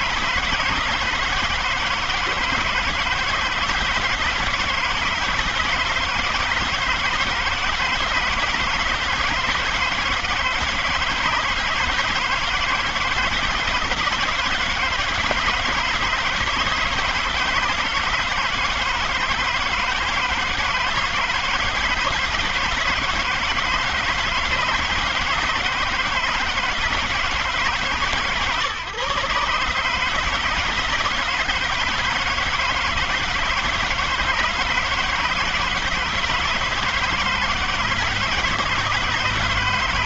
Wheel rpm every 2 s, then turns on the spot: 160, 160, 160, 160, 160, 160, 160, 160, 160, 160, 160, 160, 160, 160, 150, 150, 170, 160, 160, 160.
none